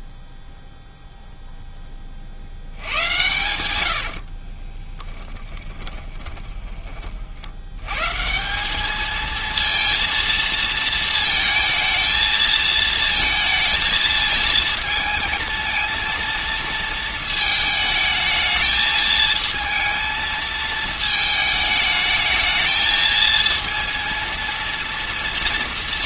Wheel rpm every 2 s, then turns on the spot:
0, 80, 20, 30, 200, 230, 220, 230, 220, 220, 220, 220, 230.
4-6